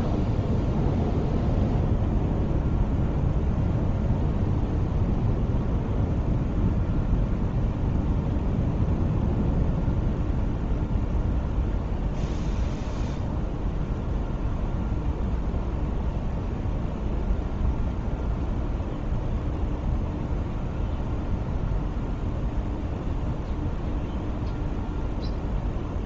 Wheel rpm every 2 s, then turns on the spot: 0, 0, 0, 0, 0, 0, 0, 0, 0, 0, 0, 0, 0.
none